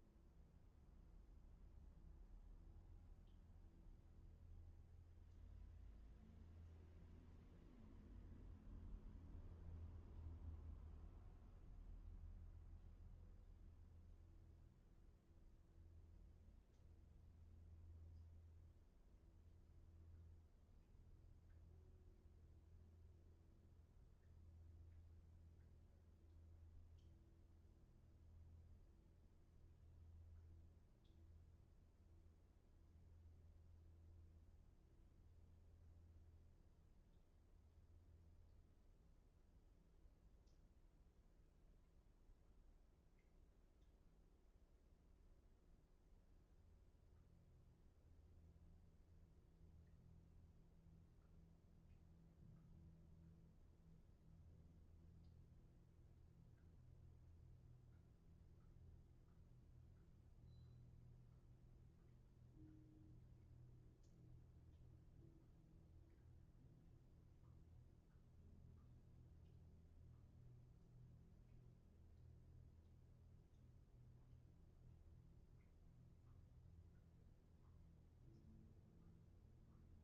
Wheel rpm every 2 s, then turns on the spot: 0, 0, 0, 0, 0, 0, 0, 0, 0, 0, 0, 0, 0, 0, 0, 0, 0, 0, 0, 0, 0, 0, 0, 0, 0, 0, 0, 0, 0, 0, 0, 0, 0, 0, 0, 0, 0, 0, 0, 0.
none